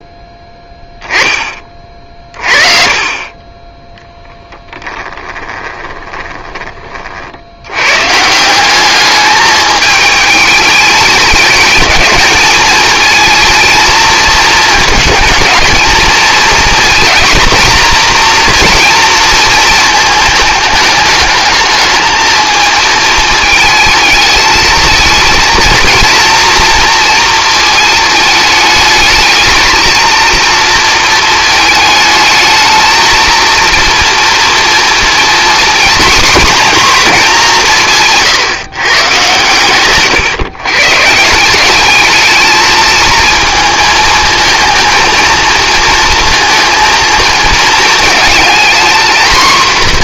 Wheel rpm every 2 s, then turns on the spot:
10, 30, 10, 30, 190, 210, 220, 220, 230, 240, 220, 220, 220, 230, 210, 230, 220, 230, 210, 140, 130, 220, 220, 230, 230.
4-6